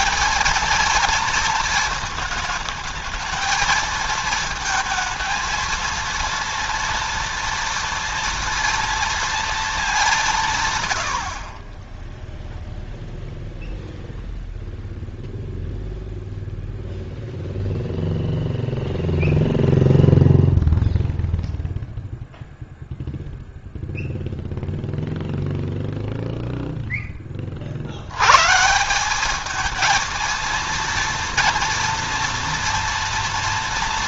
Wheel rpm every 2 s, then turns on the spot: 220, 220, 230, 230, 230, 140, 0, 0, 0, 0, 0, 0, 0, 0, 140, 230, 230.
none